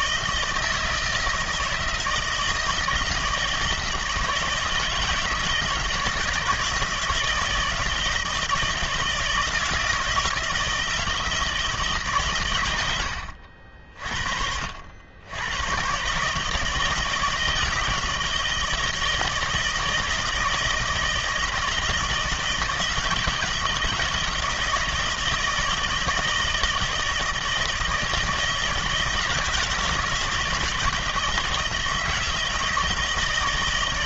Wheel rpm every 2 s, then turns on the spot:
160, 160, 160, 160, 170, 160, 110, 70, 160, 160, 160, 160, 160, 160, 160, 160, 160.
none